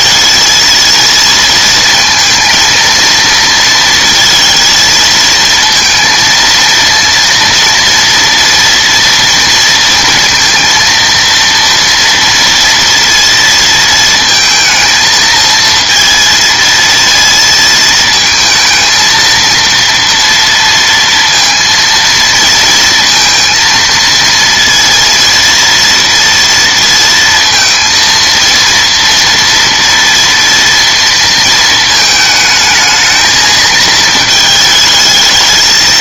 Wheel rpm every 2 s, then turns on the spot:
230, 230, 230, 230, 230, 230, 230, 220, 230, 220, 230, 230, 230, 230, 230, 230, 220, 220.
none